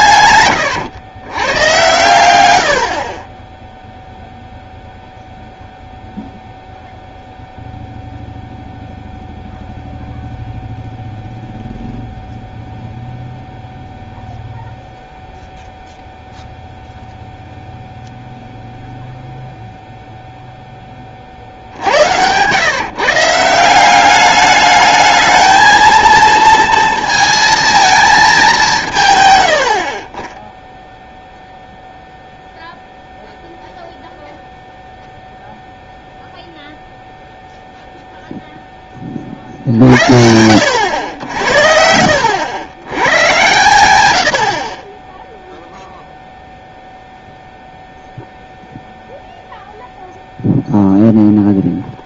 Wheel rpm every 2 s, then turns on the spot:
120, 80, 0, 0, 0, 0, 0, 0, 0, 0, 10, 130, 210, 230, 170, 0, 0, 0, 0, 0, 100, 100, 40, 0, 0, 0.
0-2